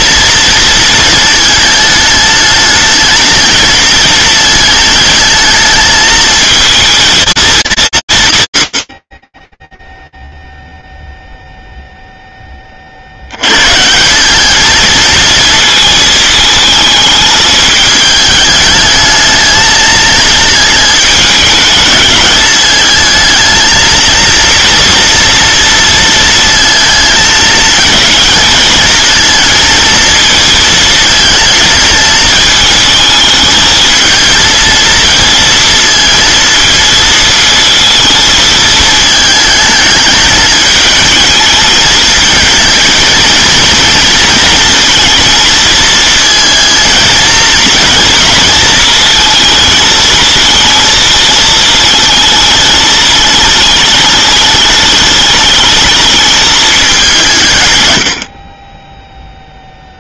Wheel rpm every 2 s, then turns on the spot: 230, 220, 220, 220, 90, 0, 40, 220, 220, 220, 220, 220, 230, 220, 220, 230, 220, 230, 230, 220, 220, 220, 220, 220, 220, 220, 220, 210, 210, 20.
none